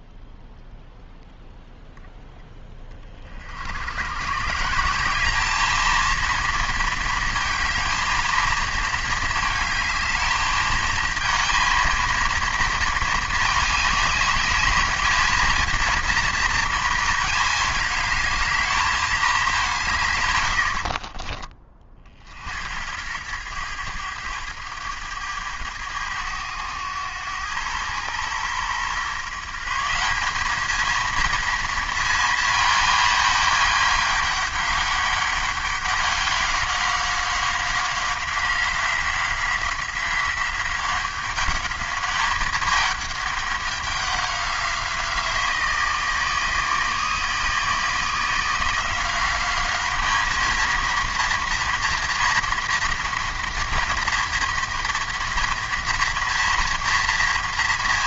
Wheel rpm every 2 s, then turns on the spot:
0, 20, 160, 230, 220, 220, 230, 210, 230, 220, 60, 80, 110, 100, 120, 210, 220, 200, 190, 180, 190, 210, 180, 160, 170, 220, 230, 230, 230.
20-22